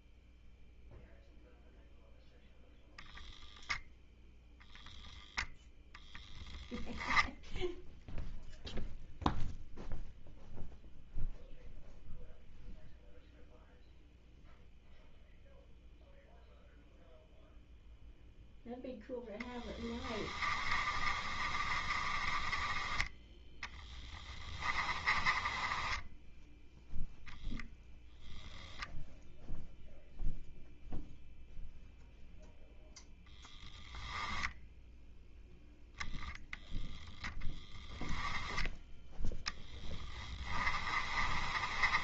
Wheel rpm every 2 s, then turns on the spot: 0, 0, 0, 10, 0, 0, 0, 0, 0, 0, 30, 20, 20, 0, 0, 0, 0, 10, 0, 10, 20.
20-26 40-42